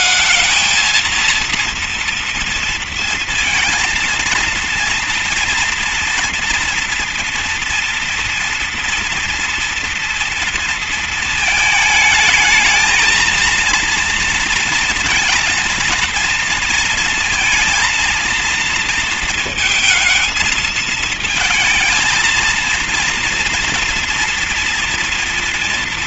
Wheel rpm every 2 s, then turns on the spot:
230, 230, 230, 230, 240, 230, 220, 230, 230, 230, 220, 230, 240.
none